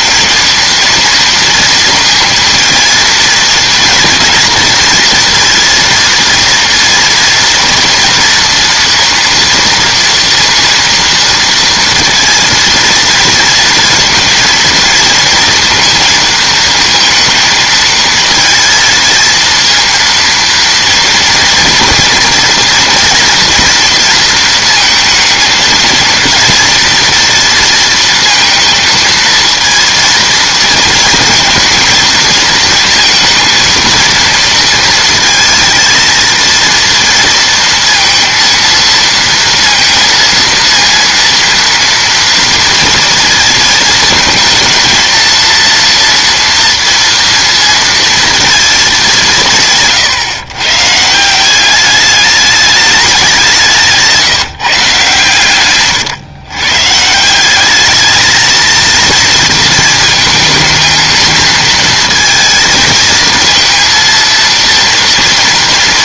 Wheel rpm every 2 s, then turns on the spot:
230, 230, 230, 230, 230, 230, 230, 230, 230, 230, 230, 240, 230, 230, 230, 230, 230, 220, 230, 230, 230, 230, 230, 230, 220, 140, 210, 160, 130, 220, 220, 220, 230.
none